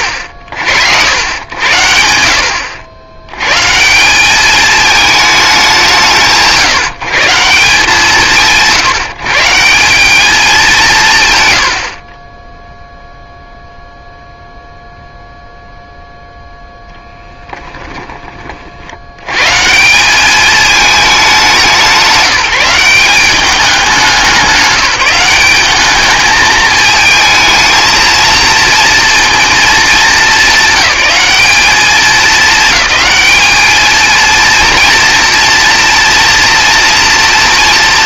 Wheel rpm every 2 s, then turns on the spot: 80, 70, 210, 150, 140, 200, 0, 0, 0, 50, 210, 180, 180, 220, 230, 190, 200, 230, 230.
none